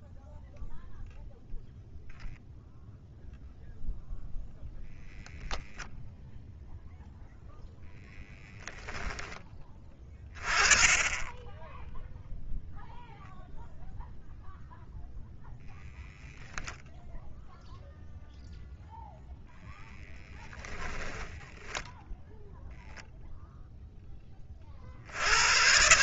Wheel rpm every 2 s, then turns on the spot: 0, 0, 0, 0, 10, 10, 0, 0, 0, 10, 0, 30, 150.
none